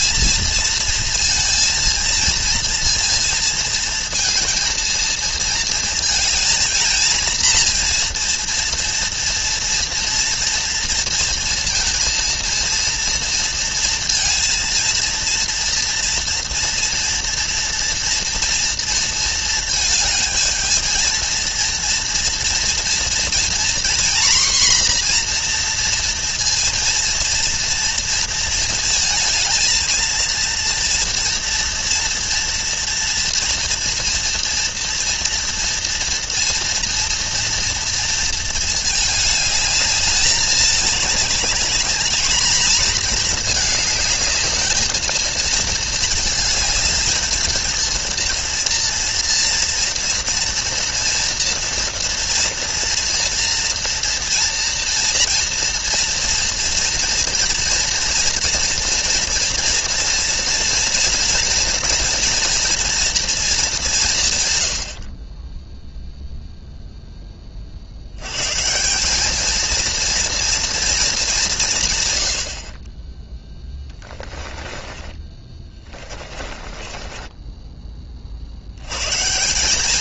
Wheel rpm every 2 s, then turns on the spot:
220, 230, 230, 220, 230, 240, 230, 230, 230, 230, 220, 230, 250, 230, 230, 230, 230, 230, 230, 220, 210, 220, 220, 220, 230, 240, 240, 230, 230, 230, 230, 230, 100, 0, 140, 230, 60, 30, 30, 90.
74-78